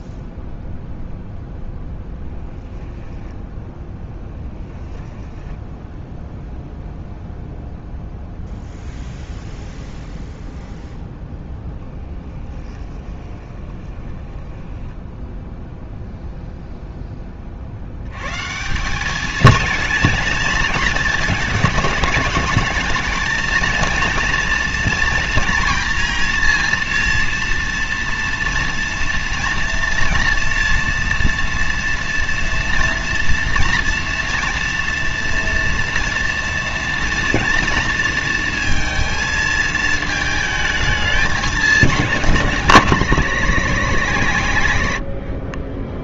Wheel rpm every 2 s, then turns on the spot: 0, 0, 10, 0, 0, 0, 10, 10, 0, 160, 220, 220, 230, 230, 230, 230, 230, 230, 230, 230, 220, 200, 140.
4-6 12-16